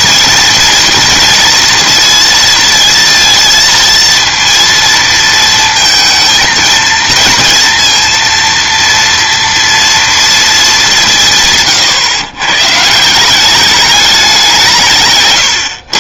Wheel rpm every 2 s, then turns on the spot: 230, 230, 230, 220, 230, 200, 150, 160.
none